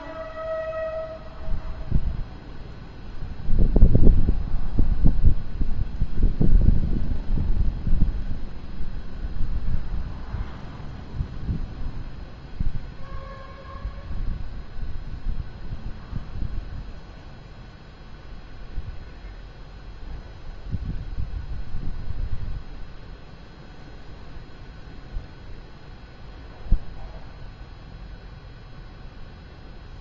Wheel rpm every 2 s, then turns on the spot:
0, 0, 0, 0, 0, 0, 0, 0, 0, 0, 0, 0, 0, 0, 0.
none